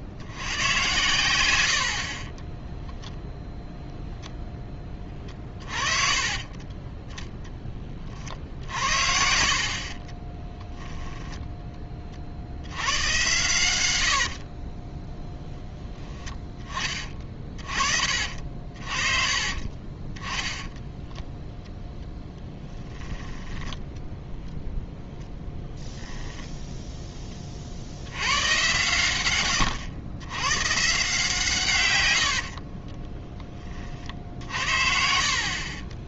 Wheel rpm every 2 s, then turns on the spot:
110, 10, 10, 20, 60, 10, 80, 30, 20, 50, 10, 10, 0, 0, 120, 140, 40, 60.
2-4 6-8 10-12 14-16 20-24 32-34